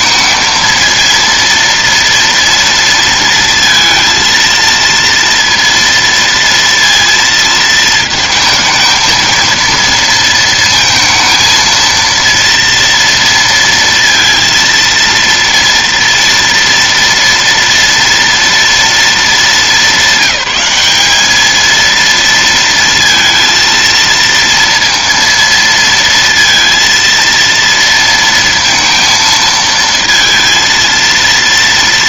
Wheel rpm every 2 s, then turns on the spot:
220, 230, 230, 230, 230, 230, 230, 230, 230, 230, 210, 230, 230, 230, 230, 230.
none